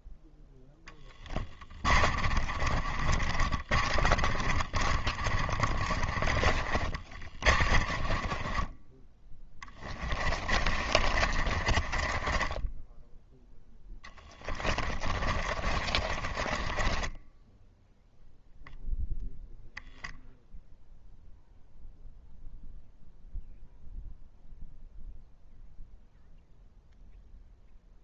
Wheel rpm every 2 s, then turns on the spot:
10, 30, 30, 30, 20, 30, 10, 20, 20, 0, 0, 0, 0, 0.
0-18